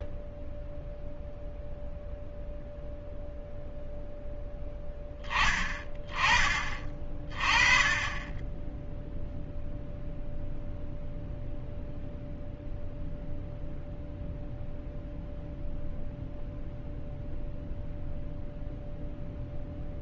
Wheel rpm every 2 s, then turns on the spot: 0, 0, 0, 30, 10, 0, 0, 0, 0, 0.
none